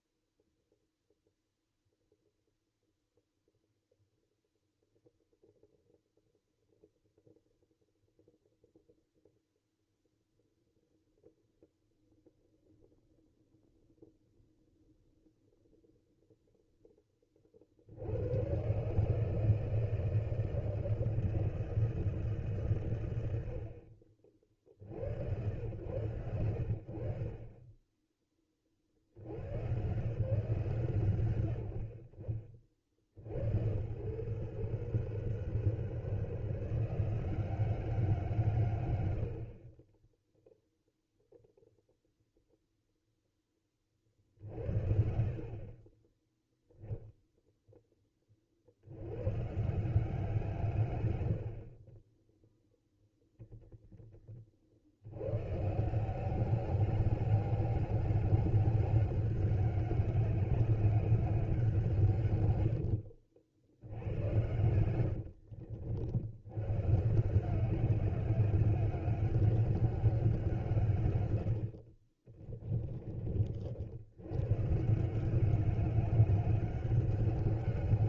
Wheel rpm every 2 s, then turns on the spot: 0, 0, 0, 0, 0, 0, 0, 0, 0, 120, 160, 140, 60, 90, 40, 150, 40, 120, 160, 130, 0, 0, 60, 0, 50, 150, 0, 40, 190, 200, 200, 100, 100, 110, 200, 170, 30, 120, 190.
62-66 72-74